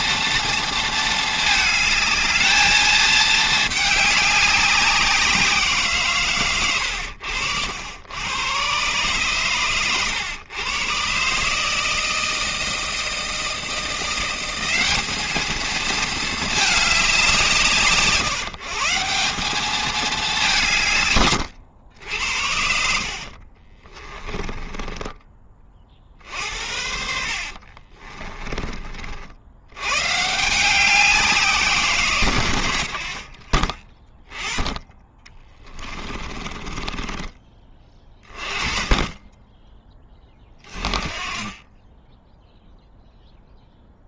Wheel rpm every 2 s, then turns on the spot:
230, 220, 190, 110, 120, 120, 160, 190, 220, 160, 160, 70, 20, 60, 30, 180, 90, 20, 20, 30, 30, 0.
22-26 36-38